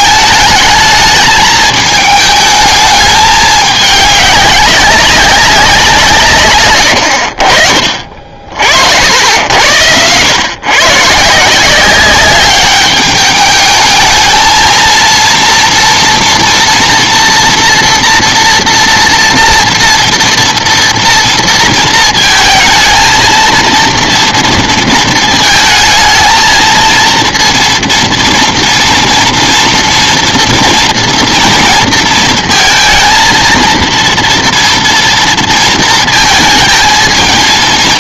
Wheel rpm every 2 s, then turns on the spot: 220, 210, 190, 90, 70, 140, 210, 230, 230, 230, 230, 230, 230, 230, 230, 230, 230, 230, 220.
none